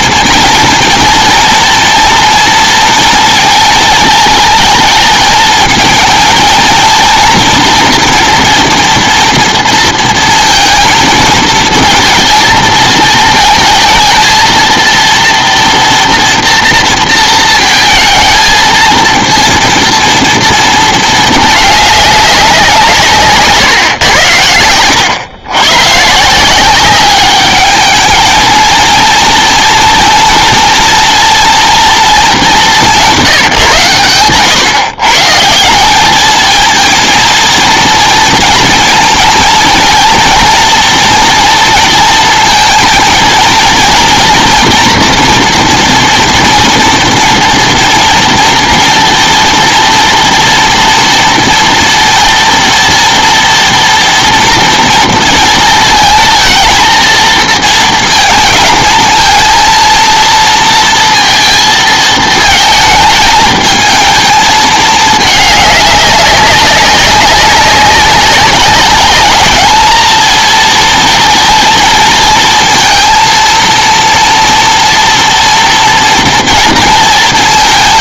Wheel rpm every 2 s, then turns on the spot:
230, 230, 220, 220, 230, 230, 220, 230, 230, 230, 230, 170, 100, 190, 230, 230, 190, 140, 220, 230, 230, 230, 240, 230, 230, 230, 230, 230, 230, 220, 230, 220, 220, 200, 200, 220, 230, 230, 230.
none